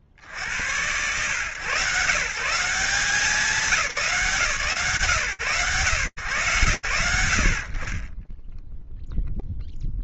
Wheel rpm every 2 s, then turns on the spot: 130, 190, 130, 60, 0.
none